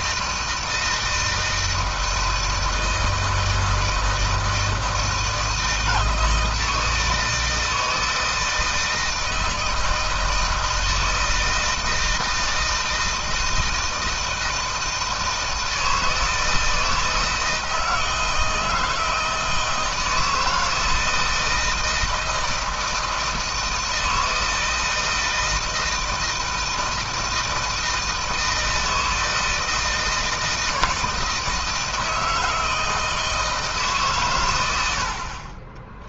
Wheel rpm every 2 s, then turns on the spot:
160, 160, 160, 160, 160, 160, 160, 160, 160, 160, 160, 160, 160, 160, 160, 160, 160, 90.
none